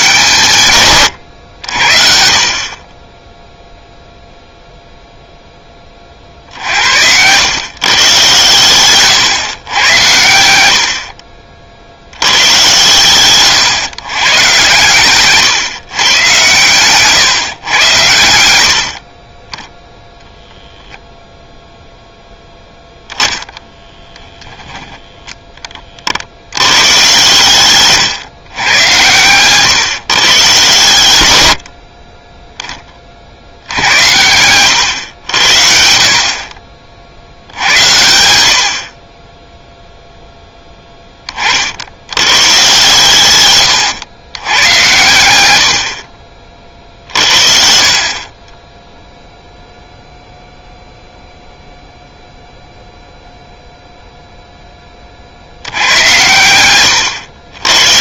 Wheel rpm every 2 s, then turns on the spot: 140, 40, 0, 60, 110, 80, 130, 120, 120, 70, 0, 0, 10, 110, 120, 130, 20, 110, 40, 70, 20, 120, 110, 50, 10, 0, 0, 10, 110.
6-8 10-12